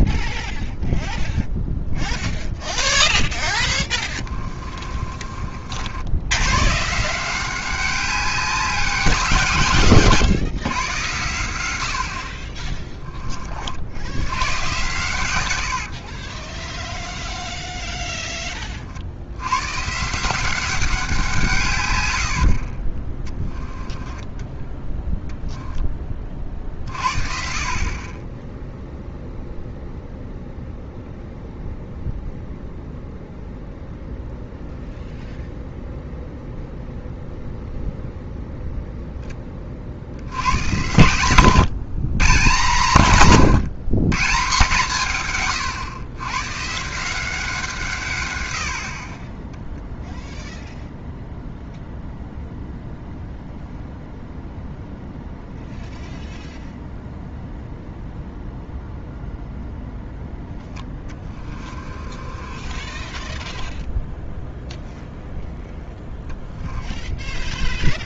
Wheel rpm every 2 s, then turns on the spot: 0, 0, 20, 110, 190, 120, 30, 120, 30, 30, 180, 60, 10, 40, 0, 0, 0, 0, 0, 0, 110, 150, 150, 140, 70, 0, 0, 0, 0, 0, 10, 30, 0, 10.
4-6 16-18 22-26 48-50 60-64 66-68